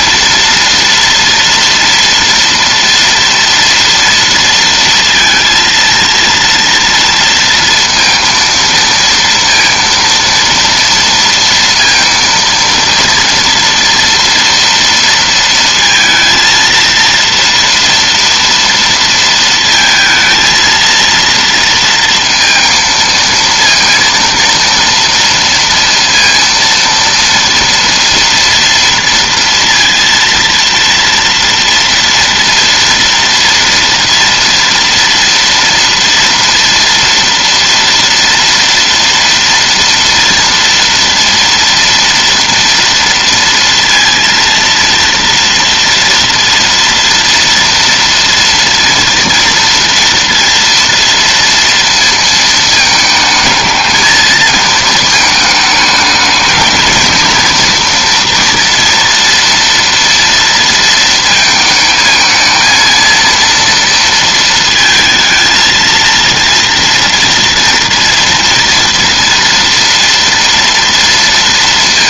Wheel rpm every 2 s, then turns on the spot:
230, 240, 230, 230, 230, 230, 230, 230, 230, 230, 230, 230, 230, 230, 230, 230, 240, 230, 230, 230, 230, 230, 230, 230, 230, 230, 220, 220, 220, 230, 230, 230, 230, 230, 230, 230.
none